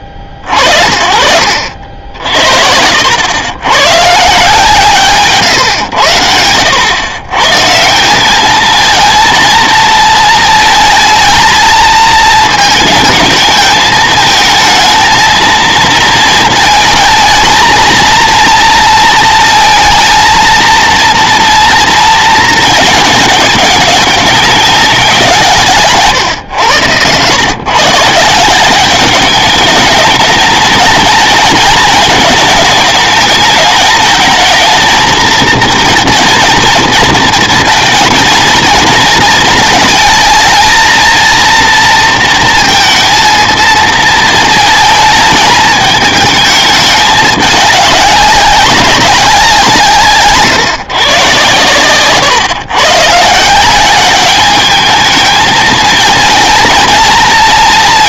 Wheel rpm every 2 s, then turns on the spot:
60, 70, 140, 90, 220, 220, 220, 230, 230, 230, 230, 220, 200, 110, 180, 220, 220, 220, 230, 230, 230, 230, 220, 220, 200, 130, 120, 210, 230.
none